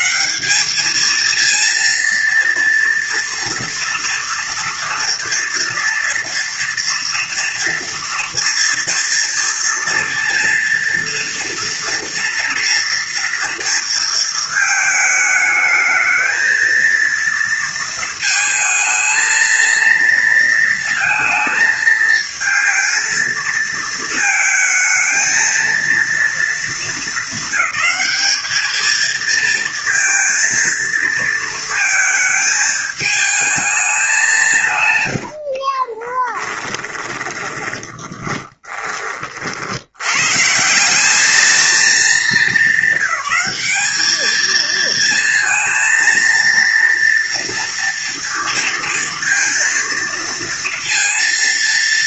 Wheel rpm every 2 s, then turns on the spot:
210, 230, 230, 230, 230, 230, 230, 220, 230, 220, 230, 230, 220, 230, 220, 230, 220, 160, 10, 20, 170, 220, 220, 230, 230, 230.
36-38